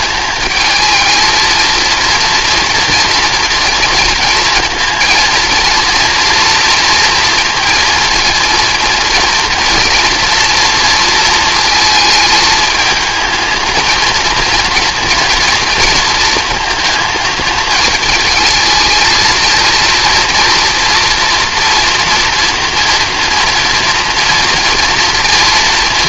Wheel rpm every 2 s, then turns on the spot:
220, 230, 230, 230, 230, 230, 220, 230, 220, 220, 240, 240, 230.
none